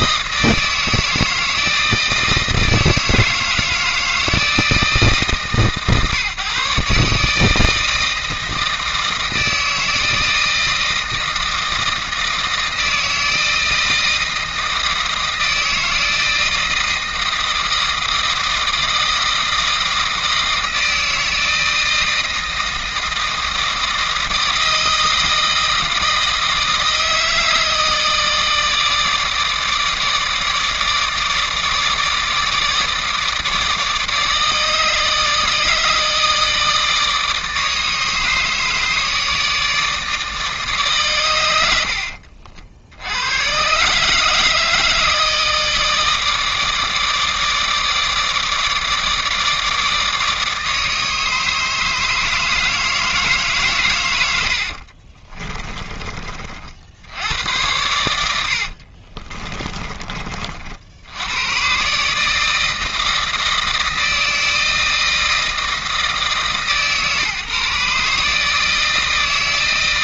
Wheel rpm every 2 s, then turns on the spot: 160, 160, 150, 140, 160, 160, 160, 160, 160, 160, 160, 160, 160, 160, 160, 150, 150, 160, 160, 150, 140, 70, 160, 150, 160, 150, 160, 70, 50, 60, 50, 160, 160, 150, 160.
54-56 58-60